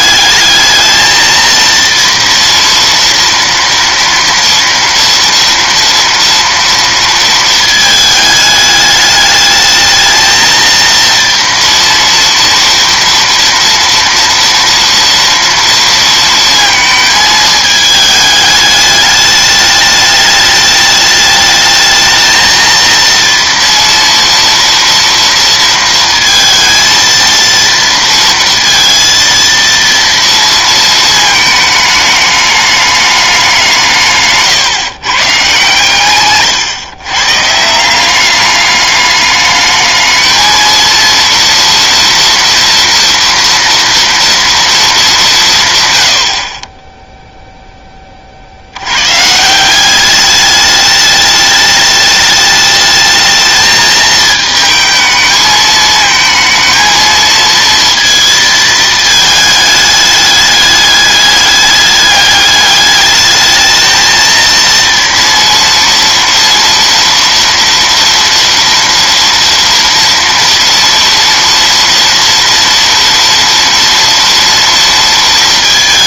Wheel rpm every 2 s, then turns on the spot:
210, 230, 230, 230, 210, 230, 230, 240, 230, 210, 210, 220, 230, 230, 230, 230, 210, 140, 130, 200, 220, 240, 230, 30, 70, 200, 210, 220, 220, 220, 210, 210, 230, 230, 230, 230, 230, 230.
none